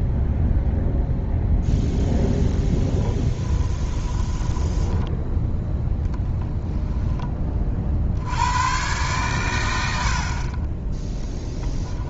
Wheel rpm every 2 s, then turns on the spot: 0, 0, 10, 10, 110, 20.
4-6